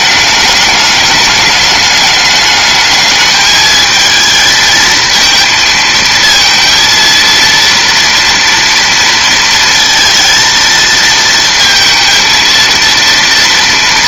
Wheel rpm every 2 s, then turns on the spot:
210, 210, 220, 230, 230, 230, 230.
none